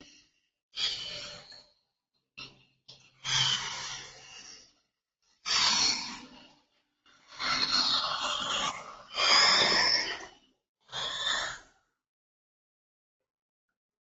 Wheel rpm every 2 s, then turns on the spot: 0, 0, 0, 0, 0, 0, 0.
none